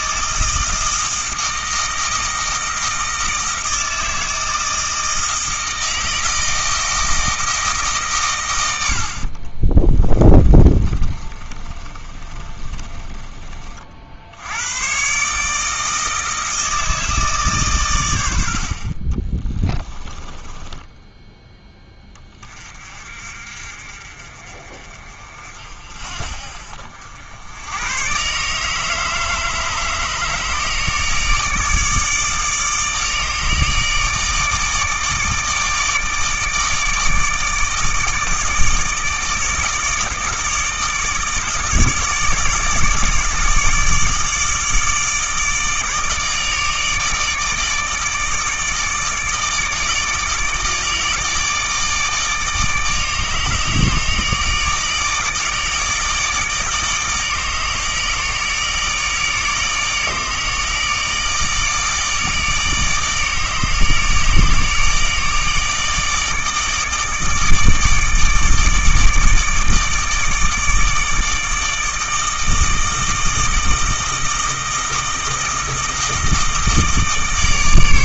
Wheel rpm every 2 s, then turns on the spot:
160, 160, 160, 160, 80, 30, 30, 100, 160, 50, 20, 40, 40, 60, 150, 150, 150, 160, 160, 150, 150, 160, 160, 150, 160, 160, 150, 150, 160, 160, 160, 150, 150, 150, 160, 150, 160, 160, 160.
10-14 20-22